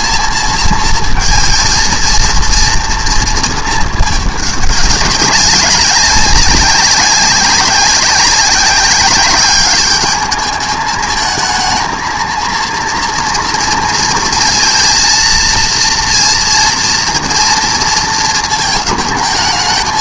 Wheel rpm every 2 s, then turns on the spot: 230, 230, 210, 200, 190, 210, 230, 230, 230, 220.
none